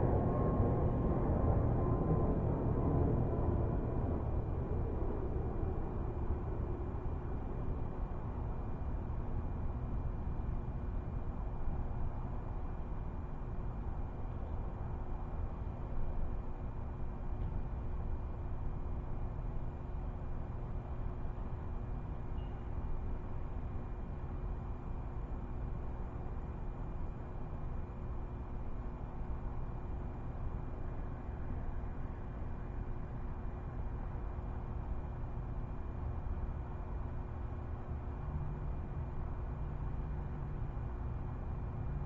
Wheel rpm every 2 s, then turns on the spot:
0, 0, 0, 0, 0, 0, 0, 0, 0, 0, 0, 0, 0, 0, 0, 0, 0, 0, 0, 0, 0.
none